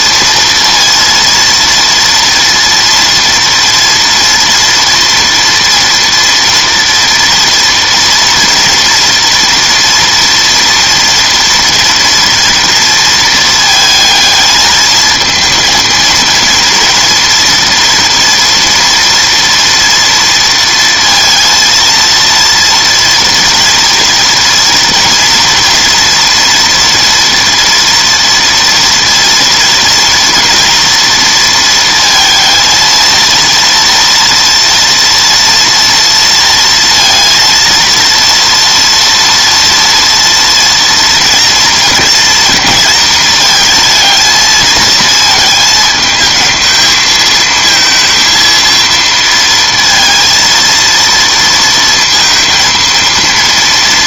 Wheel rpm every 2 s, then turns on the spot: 230, 230, 230, 230, 230, 240, 230, 220, 230, 230, 230, 230, 230, 230, 230, 230, 220, 230, 230, 230, 230, 230, 220, 220, 230, 230, 230.
none